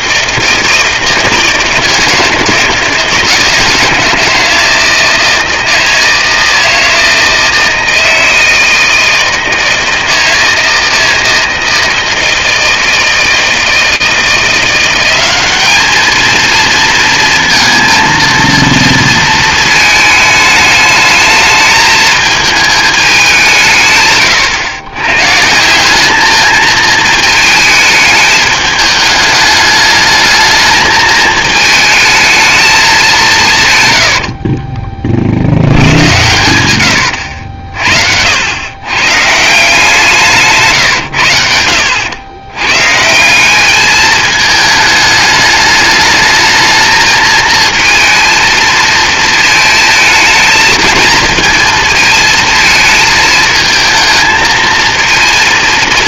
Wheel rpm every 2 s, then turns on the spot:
160, 160, 160, 160, 160, 160, 160, 200, 230, 230, 210, 180, 140, 220, 210, 220, 170, 70, 90, 160, 80, 190, 210, 220, 220, 220, 220, 230.
36-38